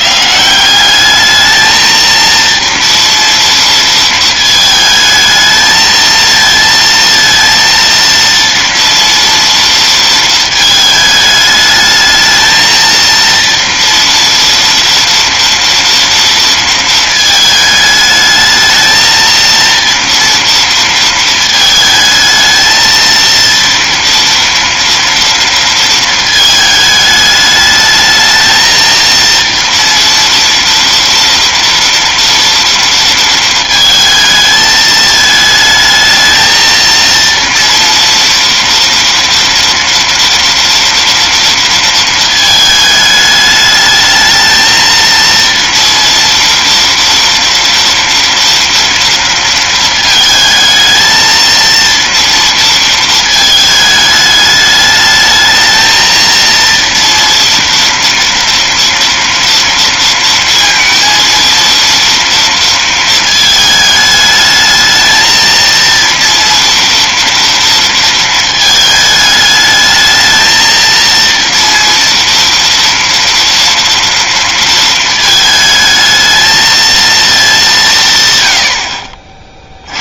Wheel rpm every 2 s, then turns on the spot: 170, 230, 220, 230, 230, 220, 220, 230, 230, 220, 230, 220, 230, 220, 230, 230, 230, 220, 220, 230, 230, 220, 220, 230, 240, 220, 230, 210, 230, 230, 230, 230, 220, 230, 220, 230, 230, 230, 220, 100.
none